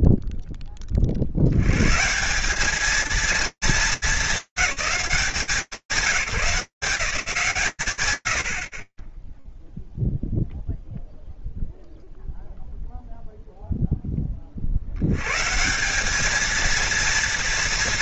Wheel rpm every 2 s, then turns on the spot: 0, 80, 220, 190, 110, 0, 0, 50, 220.
none